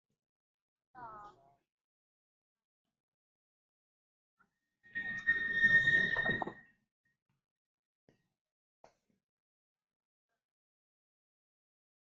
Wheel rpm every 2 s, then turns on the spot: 0, 0, 0, 0, 0, 0.
none